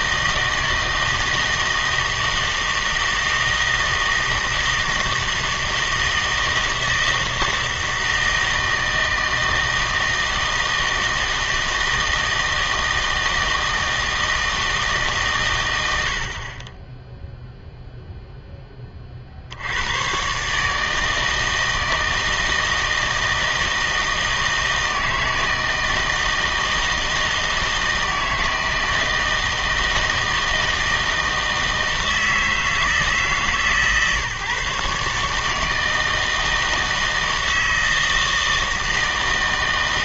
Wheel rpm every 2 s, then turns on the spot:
160, 160, 160, 160, 160, 160, 160, 160, 20, 20, 150, 160, 160, 160, 160, 160, 160, 140, 160, 160.
none